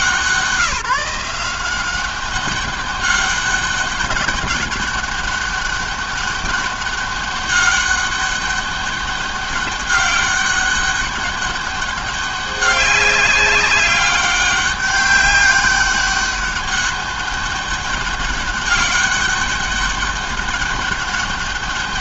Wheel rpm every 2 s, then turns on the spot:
170, 200, 200, 200, 200, 200, 190, 200, 200, 200, 200.
none